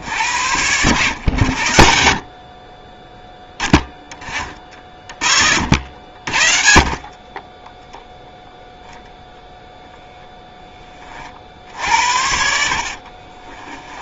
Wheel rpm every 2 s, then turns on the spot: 90, 10, 40, 40, 0, 30, 40.
12-14